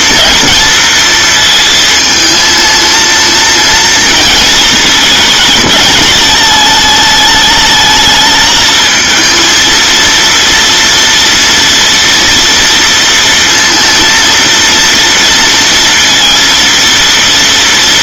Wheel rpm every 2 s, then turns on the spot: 230, 230, 220, 220, 220, 230, 230, 230, 230.
none